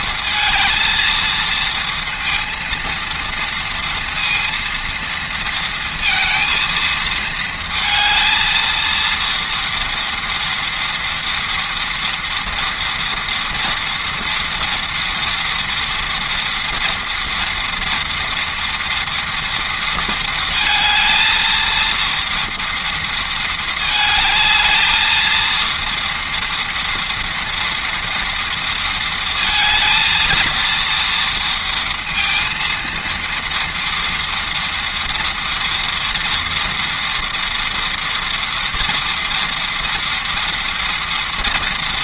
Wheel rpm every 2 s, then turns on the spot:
220, 230, 230, 230, 230, 230, 230, 230, 230, 230, 220, 230, 220, 230, 230, 230, 230, 230, 230, 230, 230.
none